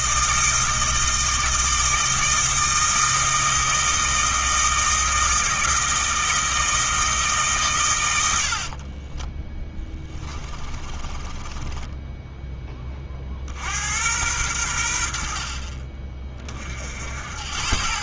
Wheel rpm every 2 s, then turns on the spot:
160, 160, 160, 160, 40, 30, 20, 80, 60.
8-12